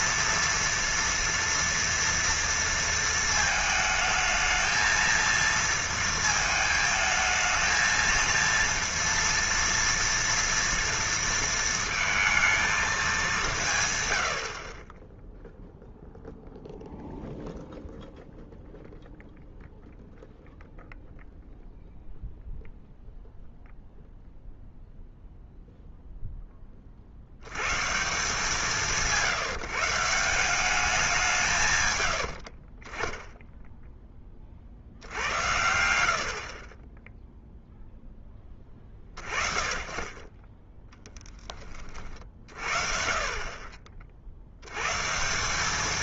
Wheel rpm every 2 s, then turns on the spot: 230, 230, 220, 220, 230, 230, 220, 50, 0, 0, 0, 0, 0, 20, 170, 190, 50, 50, 30, 20, 10, 40, 110.
none